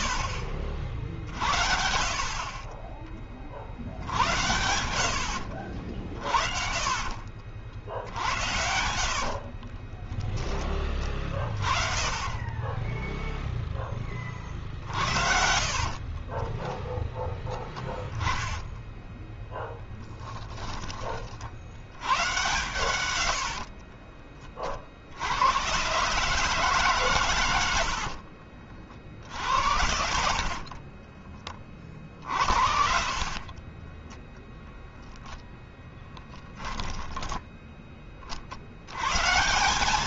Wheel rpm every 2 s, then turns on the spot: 50, 40, 90, 50, 80, 20, 10, 60, 10, 20, 30, 110, 60, 140, 50, 20, 50, 0, 10, 110.
6-10 14-16 18-20 22-24 30-34